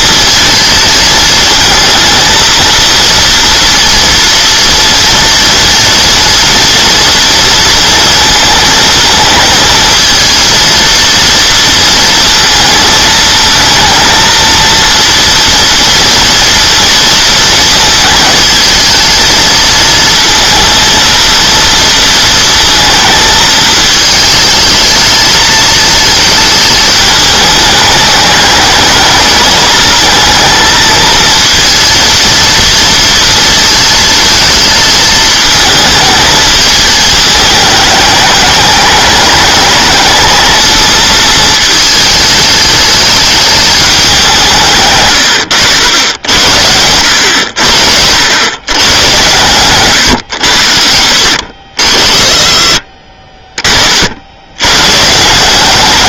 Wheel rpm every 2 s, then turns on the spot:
230, 230, 230, 230, 220, 230, 220, 230, 230, 220, 230, 230, 220, 210, 210, 220, 230, 220, 210, 210, 220, 210, 160, 90, 110, 90, 40, 110.
44-46 52-54